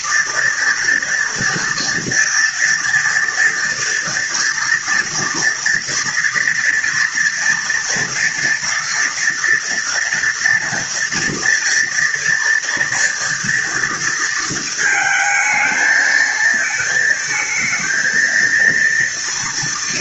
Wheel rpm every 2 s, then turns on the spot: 230, 230, 230, 230, 230, 230, 230, 220, 220, 230.
none